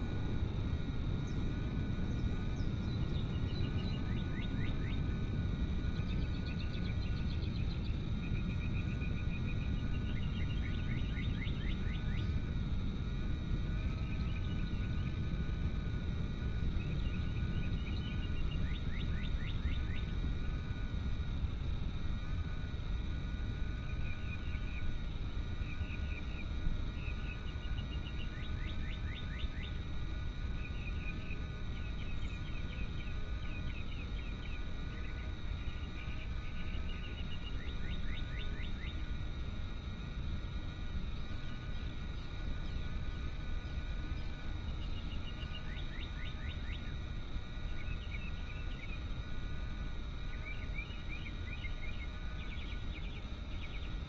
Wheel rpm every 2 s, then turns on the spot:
0, 0, 0, 0, 0, 0, 0, 0, 0, 0, 0, 0, 0, 0, 0, 0, 0, 0, 0, 0, 0, 0, 0, 0, 0, 0, 0.
none